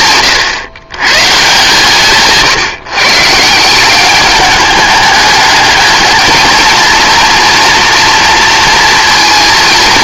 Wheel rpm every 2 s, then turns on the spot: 130, 150, 210, 230, 230.
none